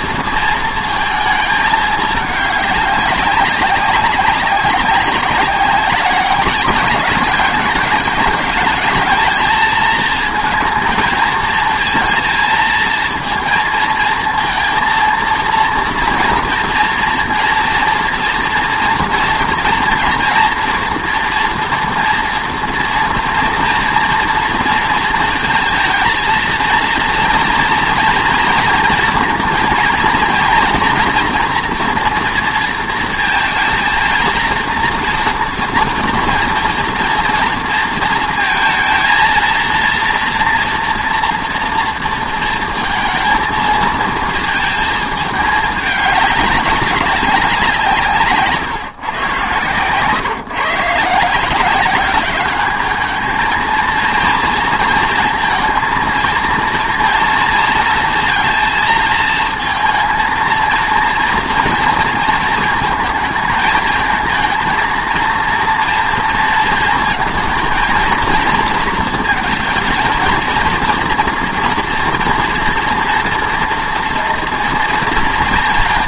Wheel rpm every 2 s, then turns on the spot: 220, 200, 190, 200, 210, 230, 220, 230, 230, 230, 230, 240, 230, 230, 230, 240, 230, 230, 240, 220, 240, 230, 220, 190, 150, 130, 210, 230, 230, 220, 230, 220, 230, 230, 230, 230, 230, 230.
none